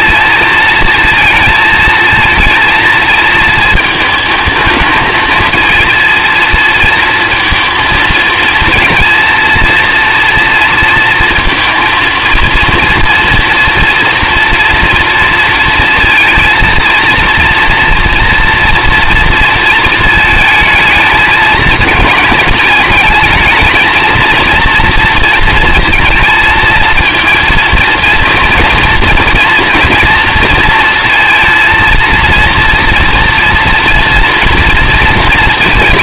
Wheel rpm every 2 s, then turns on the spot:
230, 230, 220, 230, 220, 230, 230, 240, 230, 230, 220, 210, 230, 230, 230, 230, 230, 230.
none